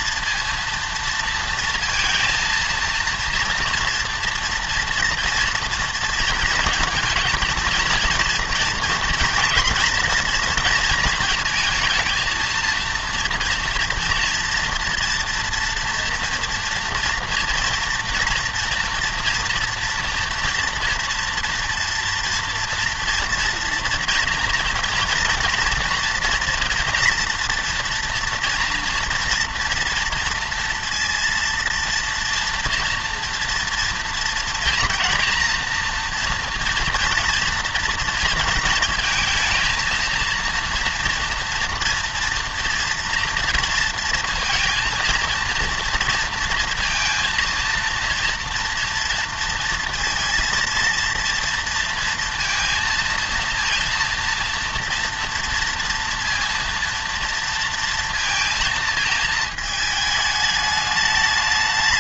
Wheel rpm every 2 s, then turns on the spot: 230, 230, 230, 230, 230, 230, 230, 230, 240, 230, 230, 230, 230, 240, 240, 230, 230, 230, 230, 230, 230, 230, 230, 230, 240, 230, 230, 230, 230, 230, 210.
none